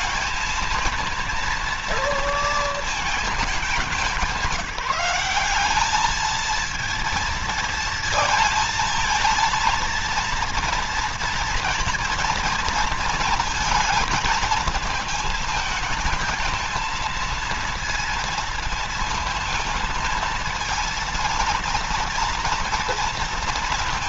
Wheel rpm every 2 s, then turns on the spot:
230, 220, 180, 230, 230, 230, 230, 230, 230, 230, 230, 230.
none